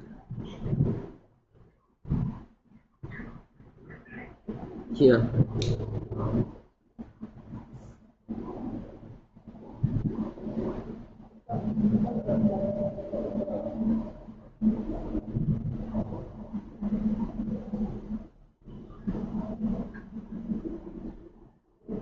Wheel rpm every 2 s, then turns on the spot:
0, 0, 0, 0, 0, 0, 0, 0, 0, 0, 0.
none